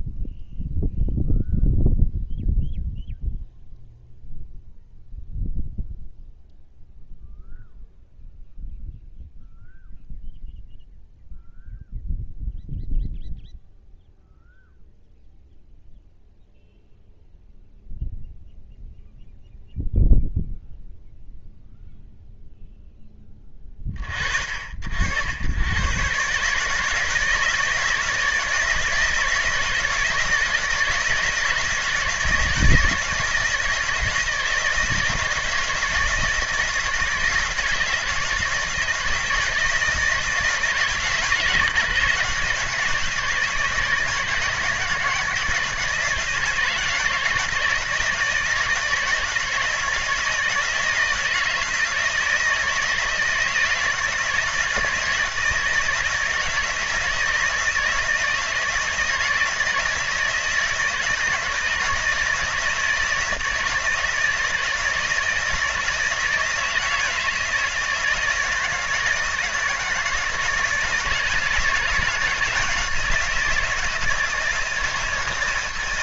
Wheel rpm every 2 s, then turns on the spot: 0, 0, 0, 0, 0, 0, 0, 0, 0, 0, 0, 0, 60, 150, 160, 160, 160, 160, 160, 160, 160, 160, 160, 160, 160, 160, 160, 160, 160, 160, 160, 160, 160, 160, 160, 160, 170, 170.
none